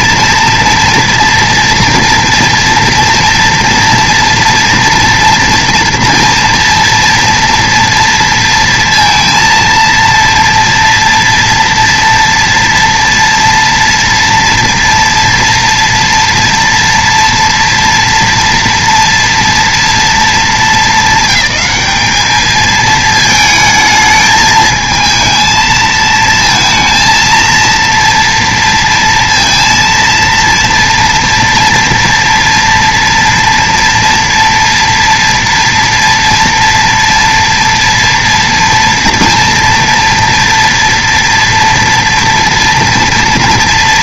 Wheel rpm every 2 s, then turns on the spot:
230, 230, 230, 230, 230, 230, 230, 230, 240, 230, 220, 220, 220, 230, 230, 230, 230, 230, 230, 230, 230, 230.
none